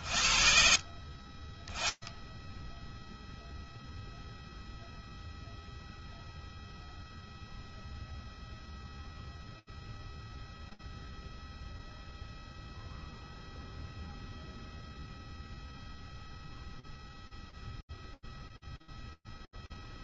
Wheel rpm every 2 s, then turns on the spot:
10, 0, 0, 0, 0, 0, 0, 0, 0, 10.
18-20